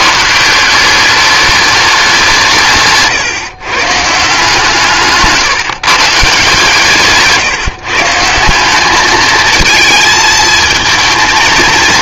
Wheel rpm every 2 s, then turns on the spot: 180, 150, 150, 140, 190, 220.
none